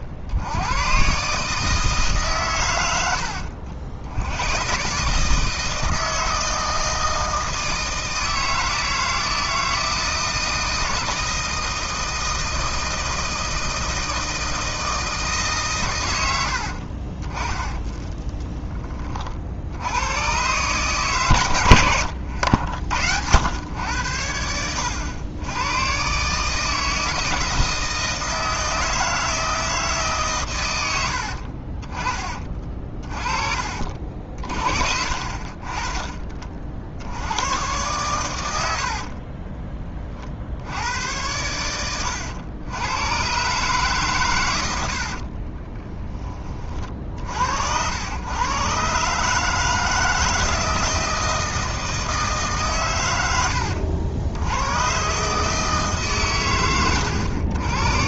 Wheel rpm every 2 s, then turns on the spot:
80, 120, 100, 160, 160, 160, 160, 160, 80, 10, 110, 70, 80, 150, 160, 120, 30, 40, 30, 90, 70, 90, 110, 30, 120, 160, 150, 90, 120.
18-20 32-34